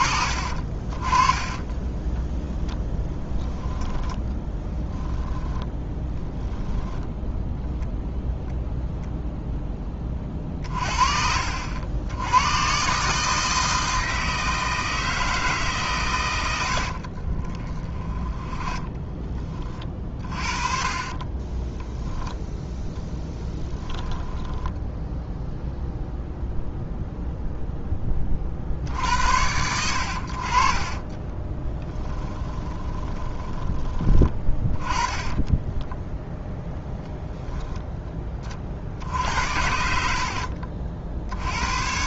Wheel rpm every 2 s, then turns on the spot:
40, 20, 10, 10, 0, 40, 120, 160, 80, 20, 30, 10, 10, 0, 40, 40, 20, 20, 0, 40, 50.
0-8 10-12 18-22 24-26 32-36 40-42